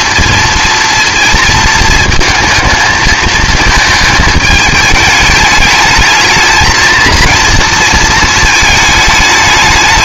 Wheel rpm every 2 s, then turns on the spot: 230, 220, 220, 230, 220.
none